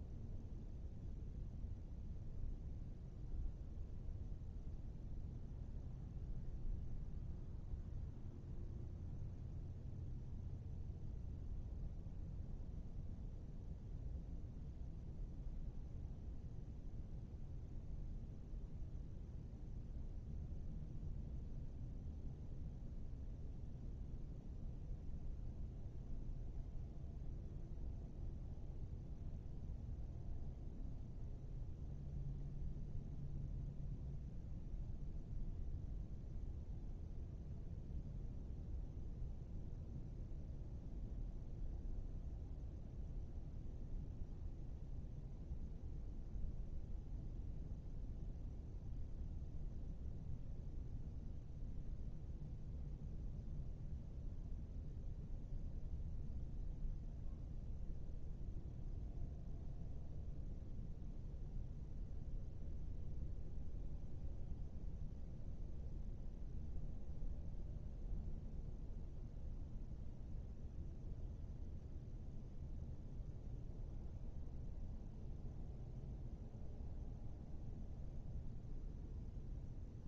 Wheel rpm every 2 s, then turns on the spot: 0, 0, 0, 0, 0, 0, 0, 0, 0, 0, 0, 0, 0, 0, 0, 0, 0, 0, 0, 0, 0, 0, 0, 0, 0, 0, 0, 0, 0, 0, 0, 0, 0, 0, 0, 0, 0, 0, 0, 0.
none